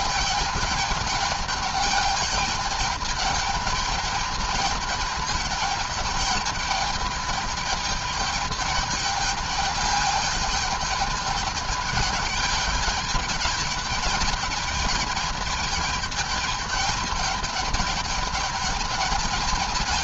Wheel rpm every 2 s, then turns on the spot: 210, 210, 210, 210, 210, 210, 210, 210, 210, 210.
none